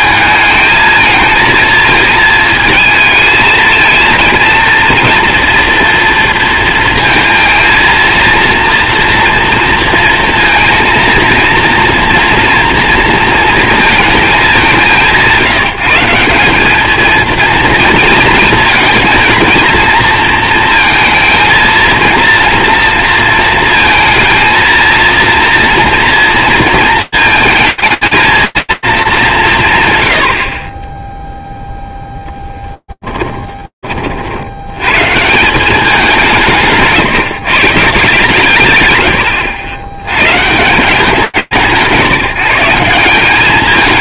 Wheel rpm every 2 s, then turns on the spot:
220, 220, 230, 220, 230, 230, 230, 170, 220, 230, 220, 230, 230, 220, 230, 50, 10, 90, 170, 130, 140, 180.
32-34